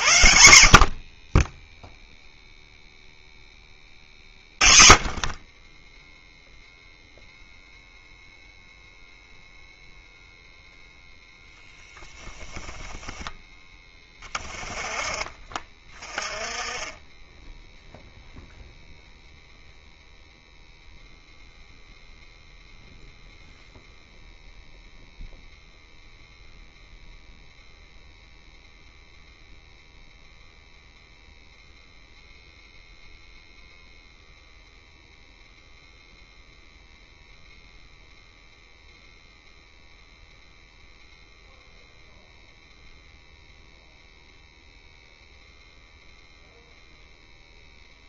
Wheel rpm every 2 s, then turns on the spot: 50, 0, 30, 0, 0, 0, 10, 20, 20, 0, 0, 0, 0, 0, 0, 0, 0, 0, 0, 0, 0, 0, 0, 0.
12-14